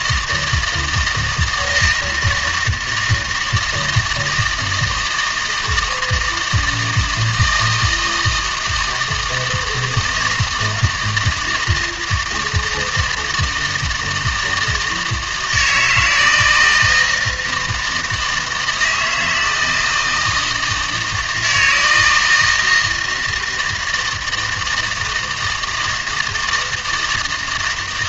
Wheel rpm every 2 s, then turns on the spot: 160, 160, 160, 160, 160, 160, 160, 160, 160, 160, 160, 160, 160, 160.
none